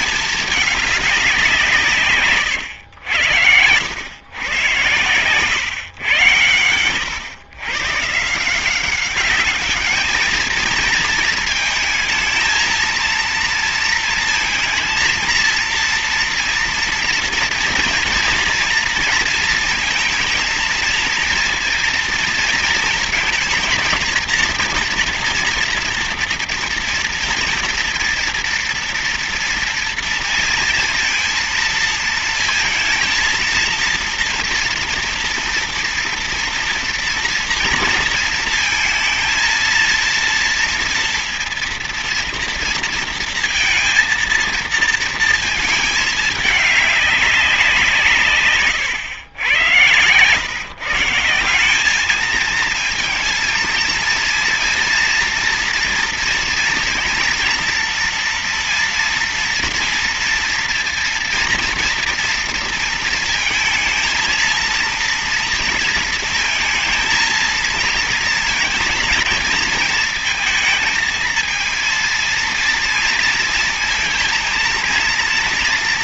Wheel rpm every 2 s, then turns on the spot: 210, 110, 110, 100, 170, 220, 230, 230, 230, 230, 230, 230, 230, 230, 240, 230, 220, 230, 230, 230, 230, 230, 230, 210, 140, 130, 220, 230, 230, 230, 230, 230, 230, 230, 230, 230, 230, 230.
none